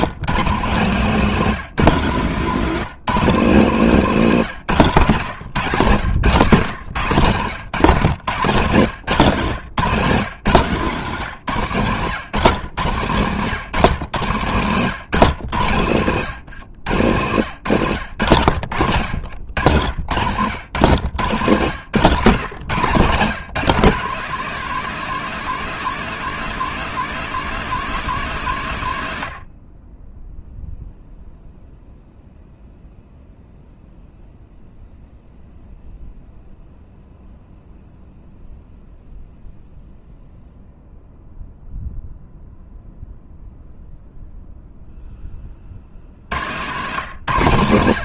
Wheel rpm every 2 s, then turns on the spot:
160, 160, 150, 140, 140, 140, 120, 130, 120, 90, 120, 150, 200, 200, 140, 0, 0, 0, 0, 0, 0, 0, 0, 130.
6-10 18-20